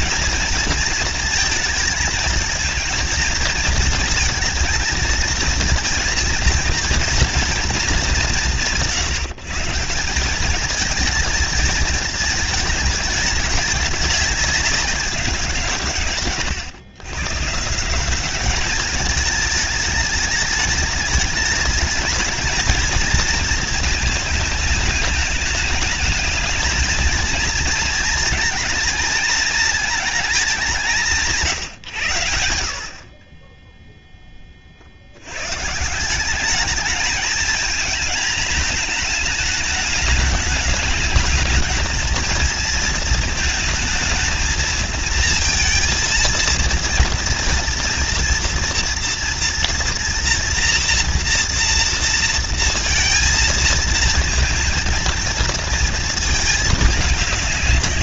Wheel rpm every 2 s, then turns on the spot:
230, 220, 230, 230, 150, 230, 210, 180, 140, 220, 210, 230, 210, 230, 220, 150, 30, 80, 220, 220, 210, 220, 230, 230, 230, 240, 230, 230, 210.
none